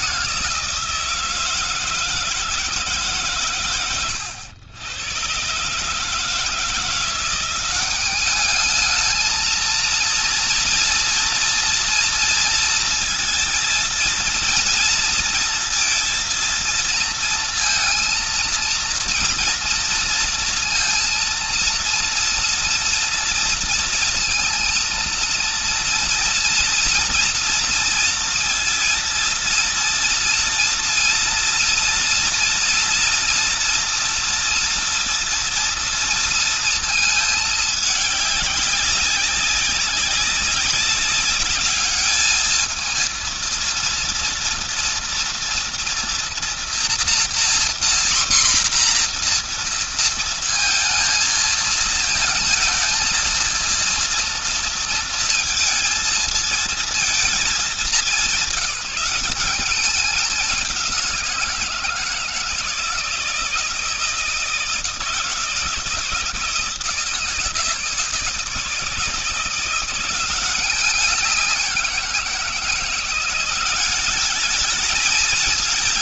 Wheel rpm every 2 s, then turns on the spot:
160, 140, 110, 180, 220, 230, 230, 230, 230, 230, 230, 230, 230, 230, 230, 230, 240, 230, 220, 200, 200, 230, 230, 240, 240, 220, 230, 230, 220, 190, 180, 160, 160, 160, 160, 190, 170, 210.
none